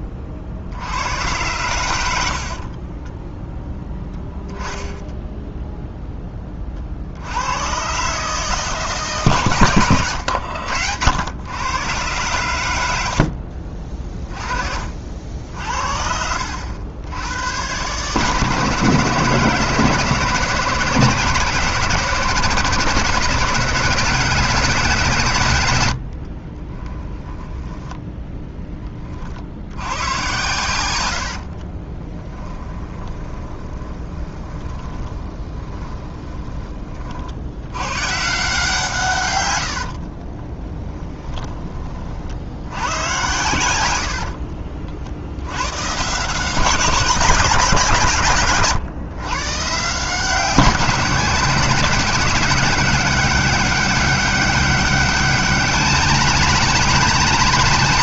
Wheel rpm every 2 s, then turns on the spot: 60, 30, 10, 50, 150, 90, 80, 50, 90, 150, 160, 170, 180, 20, 30, 100, 20, 10, 40, 150, 20, 100, 60, 190, 140, 180, 200, 200, 220.
2-4 26-28 32-36 40-42